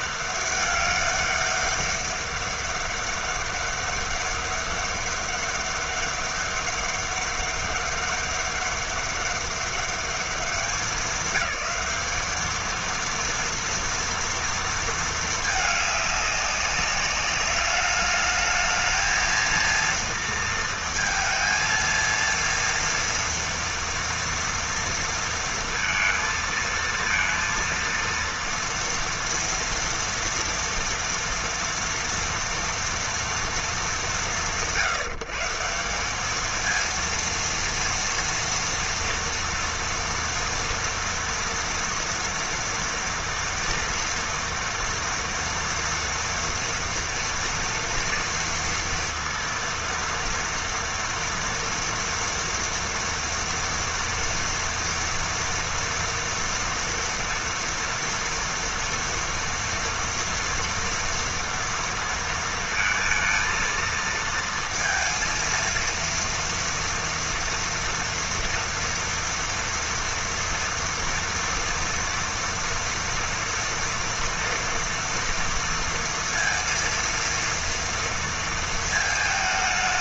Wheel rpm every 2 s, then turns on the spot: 200, 200, 200, 200, 200, 210, 220, 230, 200, 220, 230, 230, 230, 230, 230, 230, 230, 150, 230, 230, 230, 230, 230, 230, 230, 230, 230, 240, 230, 230, 230, 230, 230, 230, 230, 230, 230, 230, 230, 220.
none